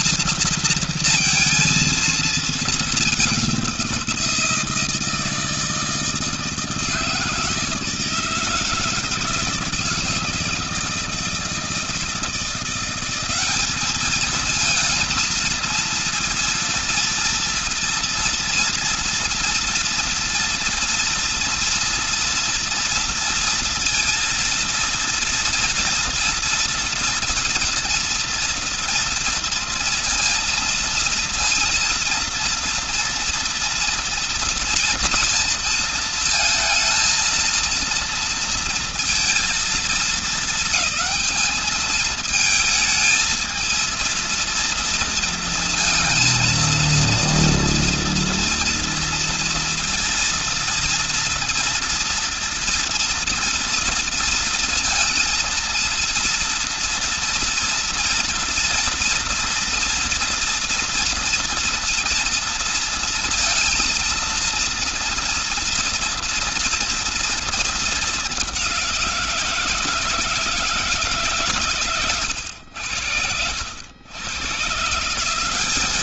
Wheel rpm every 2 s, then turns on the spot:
230, 220, 170, 160, 160, 160, 170, 220, 230, 240, 230, 230, 230, 230, 230, 230, 230, 230, 230, 230, 220, 220, 230, 230, 230, 230, 230, 230, 230, 230, 230, 230, 230, 240, 200, 160, 100, 120.
none